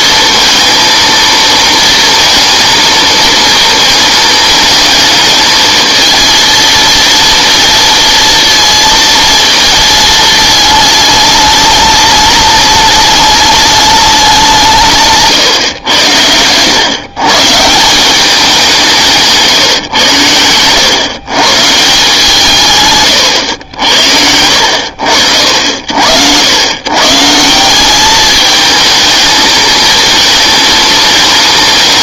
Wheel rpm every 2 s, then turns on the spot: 230, 230, 220, 230, 230, 220, 210, 180, 110, 190, 110, 150, 80, 110, 210, 220.
none